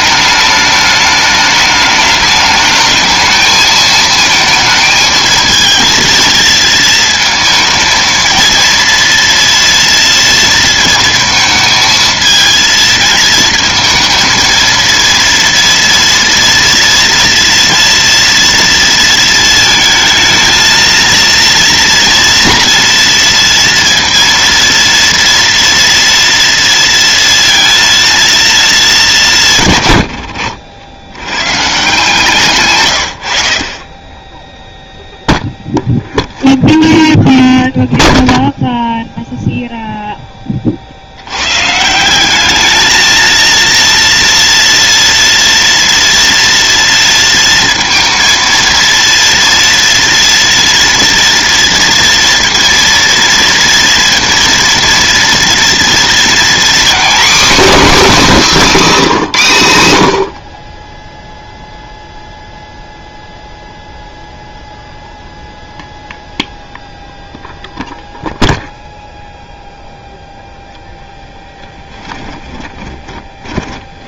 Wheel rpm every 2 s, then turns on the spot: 210, 210, 220, 230, 230, 230, 220, 230, 230, 230, 230, 230, 230, 230, 210, 80, 130, 0, 0, 0, 40, 220, 230, 230, 230, 230, 230, 230, 250, 240, 30, 0, 0, 0, 0, 0, 20.
32-34 72-74